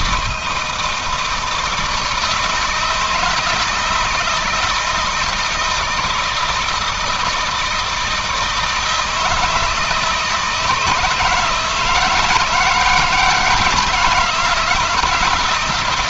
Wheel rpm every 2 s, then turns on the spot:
160, 160, 160, 160, 160, 160, 150, 160.
none